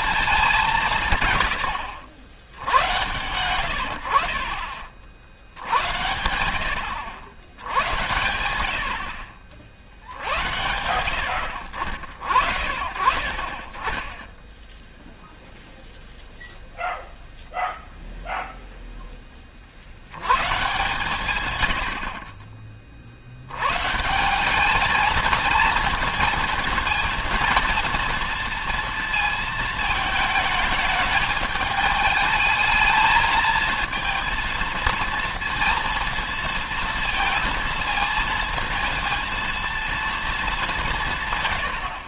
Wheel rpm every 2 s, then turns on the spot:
190, 90, 40, 90, 80, 90, 50, 10, 0, 0, 120, 40, 200, 230, 230, 220, 220, 220, 230, 220, 200.
none